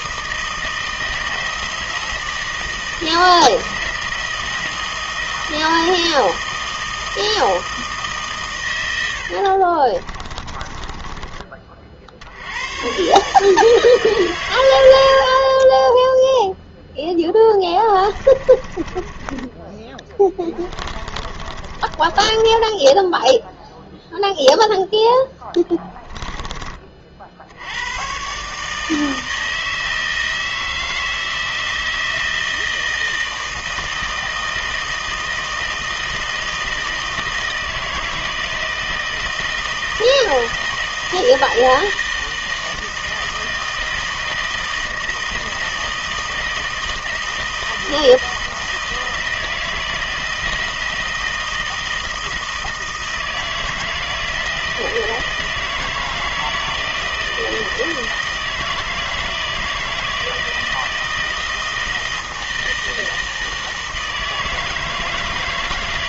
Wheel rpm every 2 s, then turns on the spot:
160, 160, 160, 160, 100, 20, 110, 100, 0, 20, 20, 10, 0, 30, 150, 160, 160, 160, 160, 160, 160, 160, 160, 160, 160, 160, 160, 160, 160, 160, 160, 160, 160.
10-12 18-24